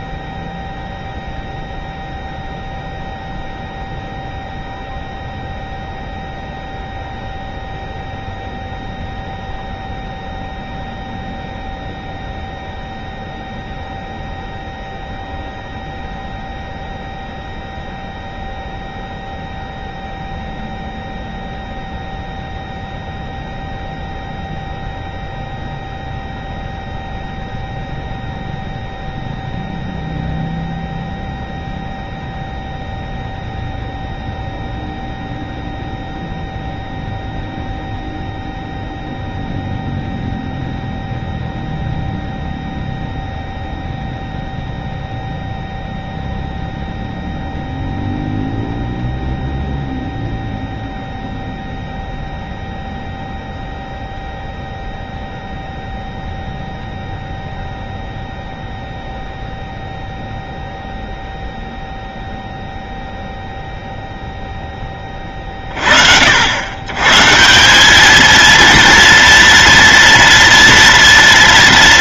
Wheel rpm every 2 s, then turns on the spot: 0, 0, 0, 0, 0, 0, 0, 0, 0, 0, 0, 0, 0, 0, 0, 0, 0, 0, 0, 0, 0, 0, 0, 0, 0, 0, 0, 0, 0, 0, 0, 0, 10, 110, 230, 230.
none